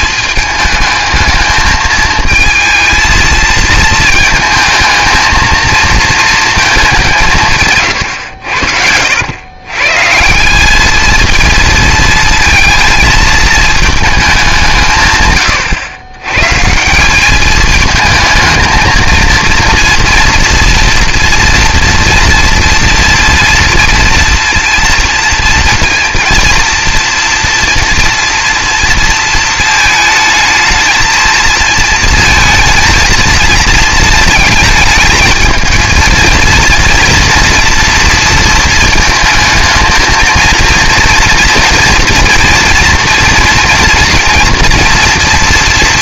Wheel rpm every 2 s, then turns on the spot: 220, 220, 220, 210, 80, 210, 230, 160, 160, 220, 230, 230, 230, 240, 230, 220, 230, 220, 230, 230, 230, 230, 240.
none